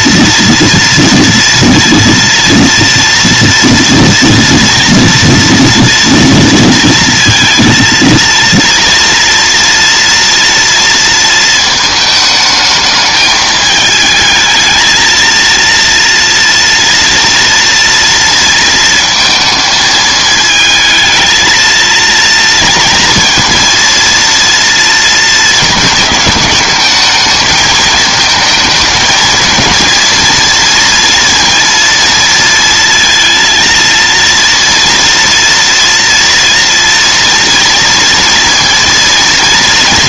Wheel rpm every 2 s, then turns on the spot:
230, 230, 230, 230, 230, 230, 220, 220, 230, 230, 220, 230, 230, 210, 220, 230, 230, 230, 230, 230.
none